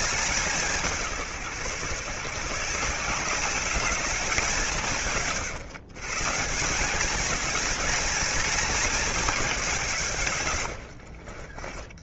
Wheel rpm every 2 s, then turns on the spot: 170, 170, 160, 190, 210, 70.
10-12